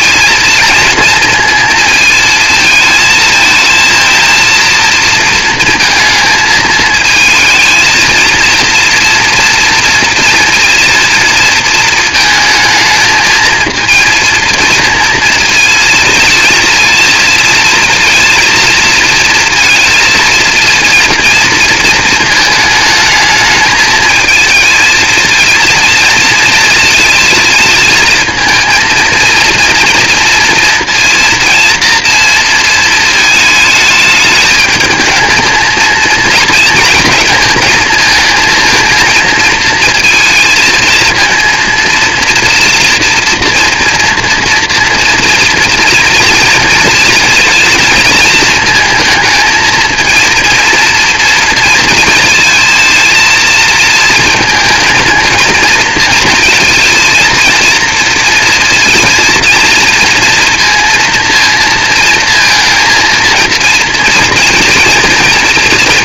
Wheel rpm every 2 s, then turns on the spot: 230, 220, 230, 220, 230, 230, 220, 230, 230, 230, 230, 220, 220, 230, 230, 230, 230, 220, 230, 230, 230, 230, 230, 230, 230, 230, 230, 220, 230, 230, 230, 230, 230.
none